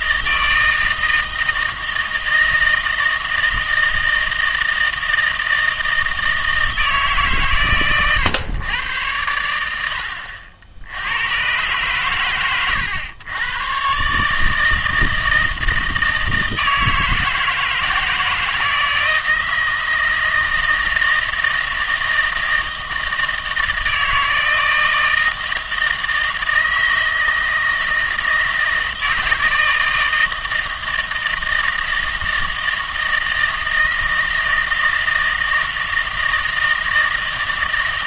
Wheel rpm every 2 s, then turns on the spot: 160, 160, 160, 160, 110, 60, 120, 160, 160, 160, 160, 160, 160, 160, 160, 160, 160, 160, 160.
none